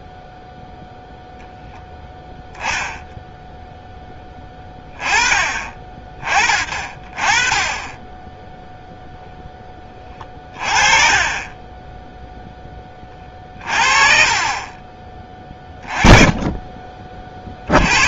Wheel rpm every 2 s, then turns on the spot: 0, 0, 10, 30, 0, 30, 20, 30, 20.
14-18